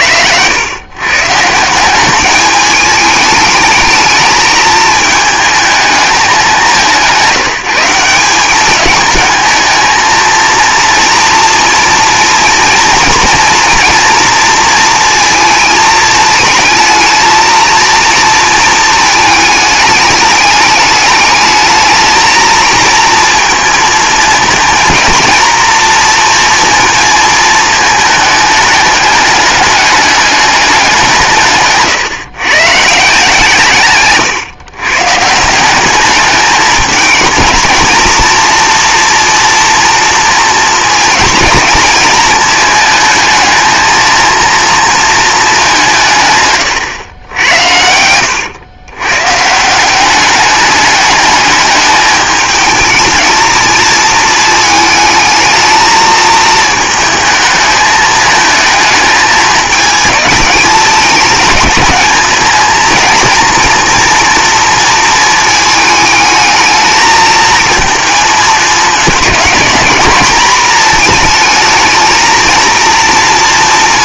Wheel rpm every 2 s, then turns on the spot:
110, 210, 210, 190, 210, 230, 230, 230, 220, 230, 210, 220, 230, 230, 210, 200, 150, 130, 220, 230, 230, 220, 230, 110, 120, 210, 220, 220, 220, 220, 210, 230, 230, 220, 220, 220, 230.
none